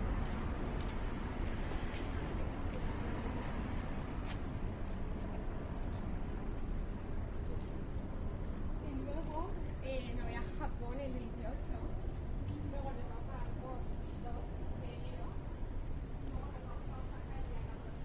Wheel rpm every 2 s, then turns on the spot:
0, 0, 0, 0, 0, 0, 0, 0, 0.
none